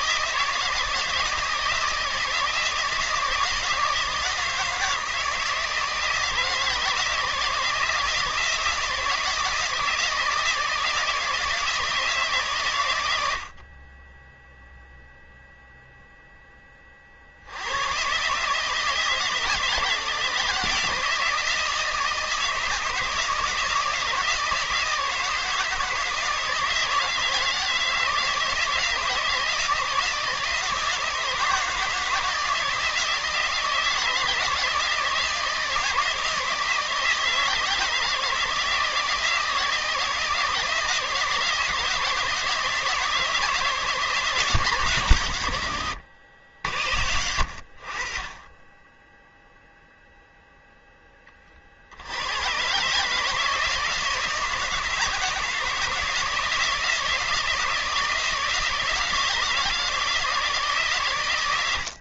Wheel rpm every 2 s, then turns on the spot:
160, 160, 160, 160, 160, 160, 100, 0, 40, 160, 160, 160, 160, 160, 160, 160, 160, 160, 160, 160, 160, 150, 130, 70, 10, 10, 140, 160, 160, 160, 140.
none